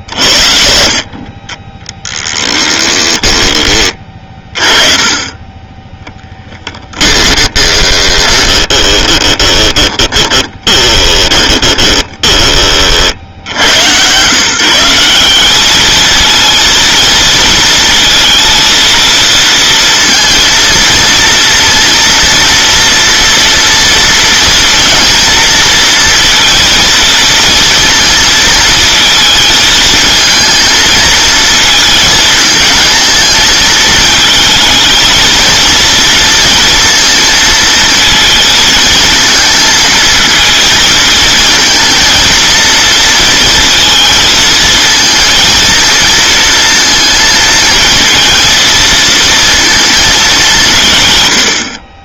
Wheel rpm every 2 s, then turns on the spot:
50, 10, 30, 10, 20, 20, 50, 180, 230, 230, 230, 230, 230, 230, 230, 220, 220, 220, 230, 220, 230, 230, 230, 230, 230, 160.
2-4 6-12